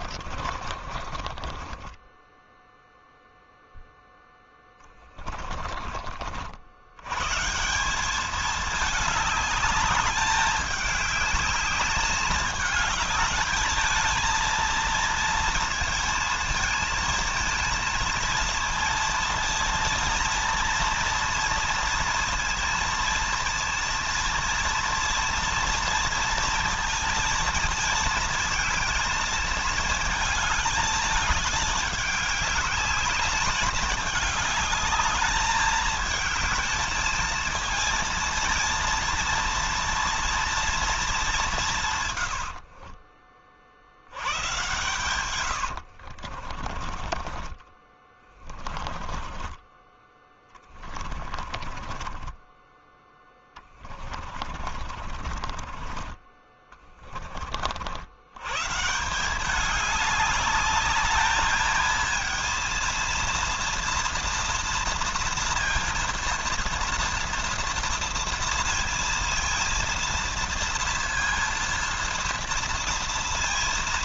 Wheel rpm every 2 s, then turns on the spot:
50, 0, 10, 100, 210, 210, 210, 230, 220, 230, 230, 230, 230, 230, 220, 220, 200, 210, 220, 230, 220, 40, 110, 30, 20, 30, 10, 40, 30, 170, 210, 230, 230, 230, 230, 230, 230.
0-2 4-6 42-56